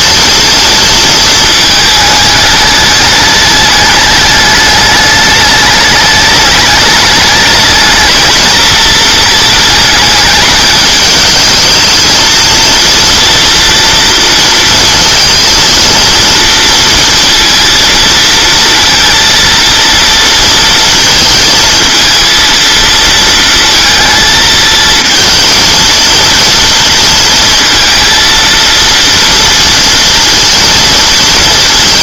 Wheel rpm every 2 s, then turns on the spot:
230, 210, 210, 210, 220, 210, 230, 230, 230, 230, 230, 230, 220, 230, 230, 230.
none